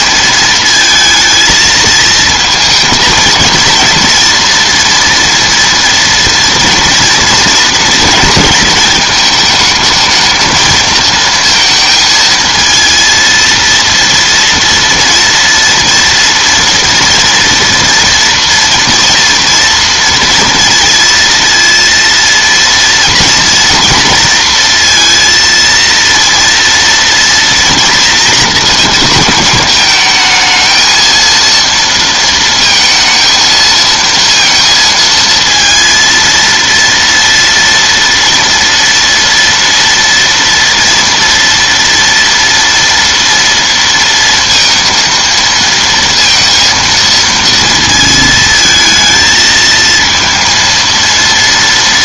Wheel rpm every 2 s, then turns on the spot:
220, 220, 240, 240, 220, 220, 220, 230, 230, 230, 230, 230, 230, 230, 240, 220, 230, 230, 230, 230, 230, 230, 230, 230, 220, 230.
none